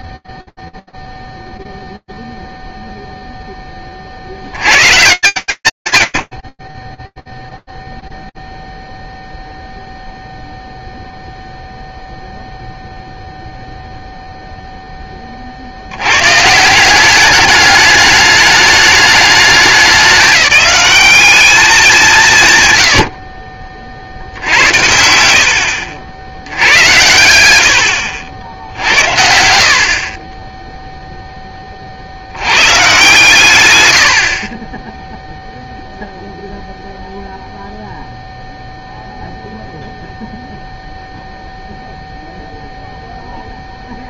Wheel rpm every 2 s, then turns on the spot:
0, 0, 100, 30, 0, 0, 0, 20, 190, 210, 200, 90, 80, 100, 70, 10, 130, 0, 0, 0, 0, 0.
24-26